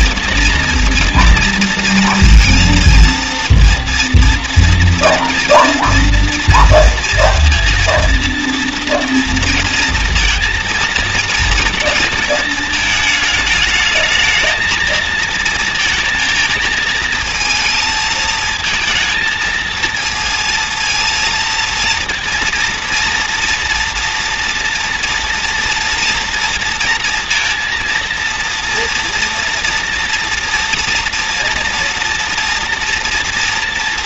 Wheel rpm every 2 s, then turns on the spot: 230, 230, 230, 230, 230, 230, 220, 230, 230, 220, 230, 230, 230, 230, 230, 230, 240.
none